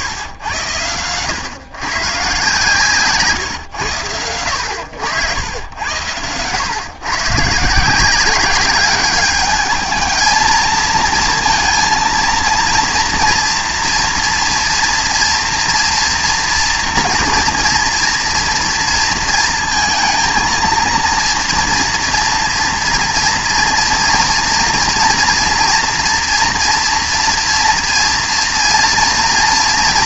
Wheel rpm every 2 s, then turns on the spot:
110, 140, 100, 120, 190, 220, 230, 230, 240, 230, 230, 240, 240, 230, 230.
none